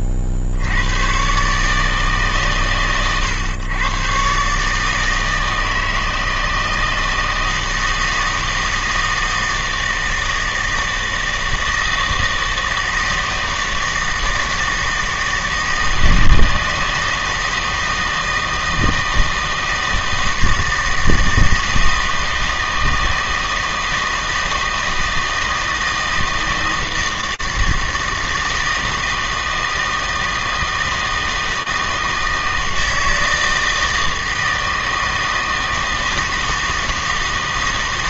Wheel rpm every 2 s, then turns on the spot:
80, 130, 150, 160, 160, 160, 160, 160, 160, 160, 160, 160, 160, 160, 160, 160, 160, 160, 160.
none